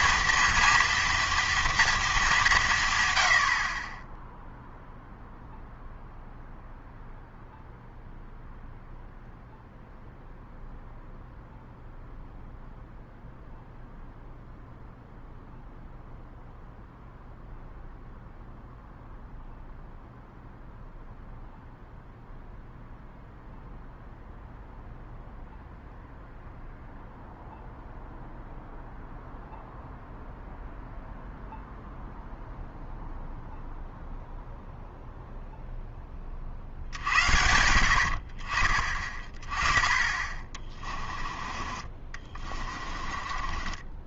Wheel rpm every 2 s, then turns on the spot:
230, 180, 0, 0, 0, 0, 0, 0, 0, 0, 0, 0, 0, 0, 0, 0, 0, 0, 50, 40, 30, 30.
40-44